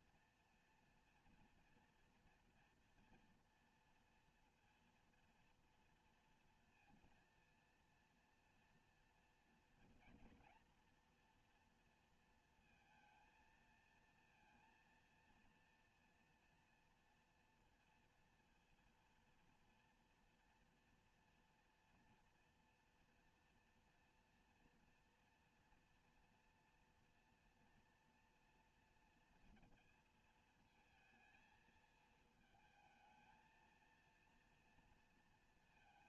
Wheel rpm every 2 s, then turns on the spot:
230, 230, 230, 230, 230, 240, 230, 230, 230, 230, 230, 230, 230, 230, 230, 220, 220, 230.
none